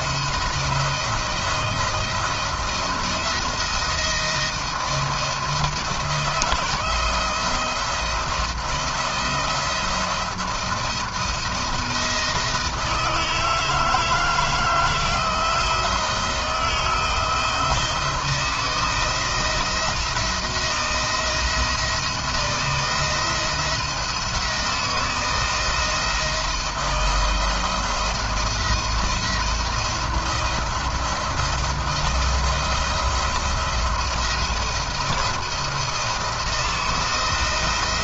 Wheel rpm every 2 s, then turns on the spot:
160, 170, 170, 160, 170, 170, 160, 160, 170, 160, 170, 170, 160, 170, 170, 170, 170, 170, 170.
none